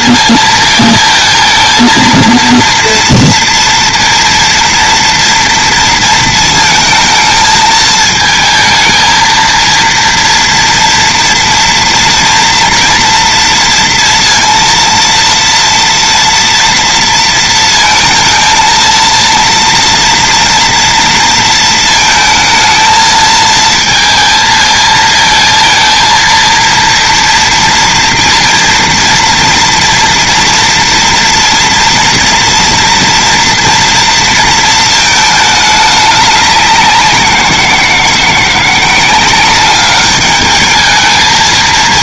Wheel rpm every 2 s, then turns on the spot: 220, 230, 230, 220, 230, 230, 230, 230, 230, 230, 230, 220, 220, 230, 230, 240, 240, 220, 180, 180, 220.
none